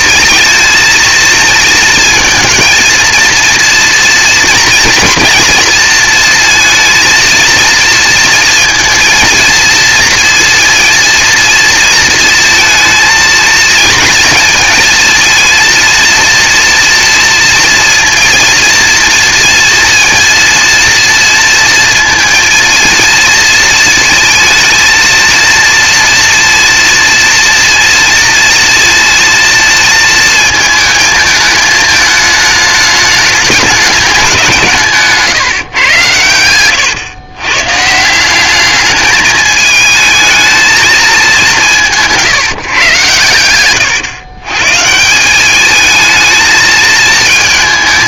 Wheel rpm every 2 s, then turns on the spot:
230, 220, 230, 230, 230, 230, 220, 230, 230, 230, 230, 230, 220, 230, 230, 220, 210, 170, 110, 200, 220, 140, 140, 220.
36-38